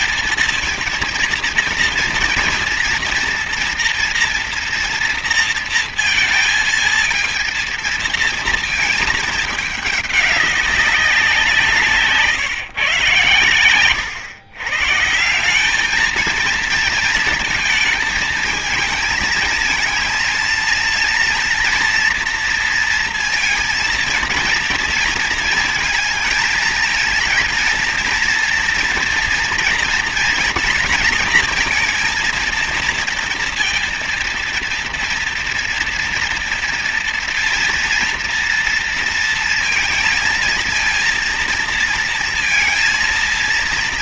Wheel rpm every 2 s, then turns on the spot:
230, 230, 240, 230, 230, 200, 150, 120, 220, 220, 220, 230, 230, 220, 230, 230, 230, 230, 230, 230, 230, 230.
none